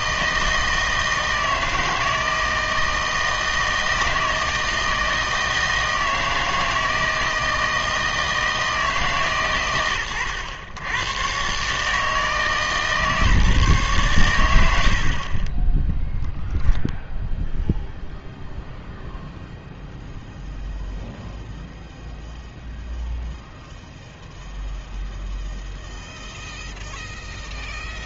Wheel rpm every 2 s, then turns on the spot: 160, 160, 160, 160, 150, 100, 150, 70, 0, 0, 0, 0, 0, 0.
none